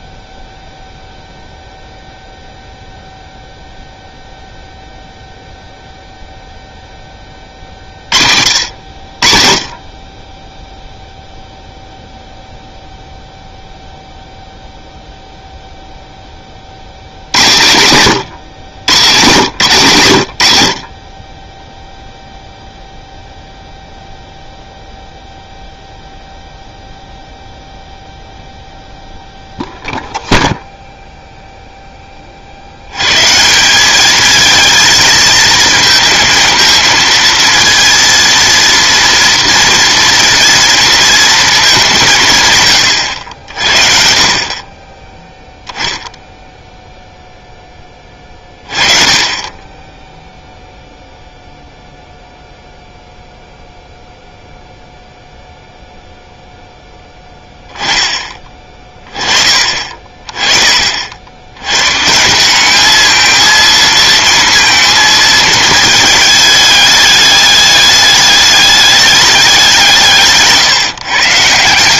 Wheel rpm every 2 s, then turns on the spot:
0, 0, 0, 0, 50, 0, 0, 0, 50, 110, 70, 0, 0, 0, 0, 0, 70, 220, 220, 230, 230, 130, 20, 0, 30, 0, 0, 0, 0, 30, 40, 200, 230, 210, 210, 150.
none